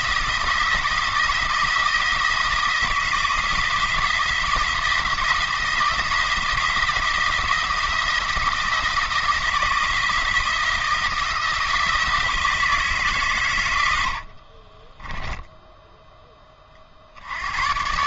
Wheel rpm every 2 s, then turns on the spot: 170, 170, 170, 170, 160, 170, 160, 30, 40.
14-16